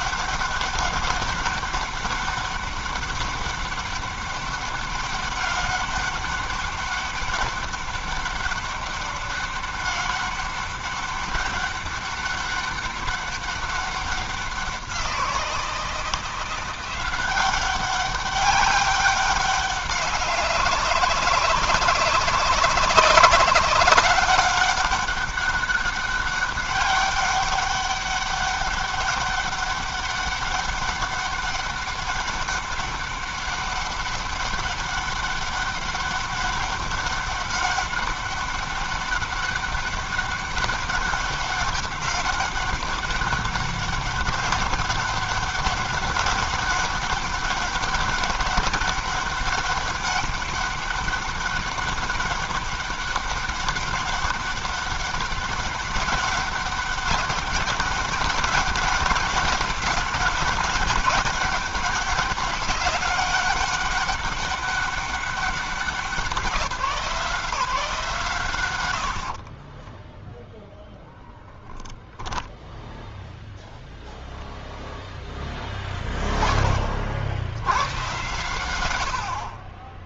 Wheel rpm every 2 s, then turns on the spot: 200, 200, 200, 200, 200, 200, 200, 190, 170, 200, 200, 190, 200, 200, 200, 200, 200, 200, 200, 200, 200, 190, 200, 200, 200, 200, 200, 200, 200, 200, 200, 200, 200, 180, 110, 0, 0, 0, 30, 110.
none